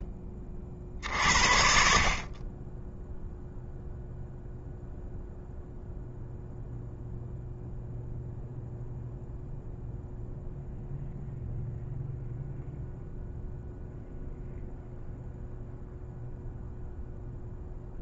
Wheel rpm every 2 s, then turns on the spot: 30, 20, 0, 0, 0, 0, 0, 0, 0.
none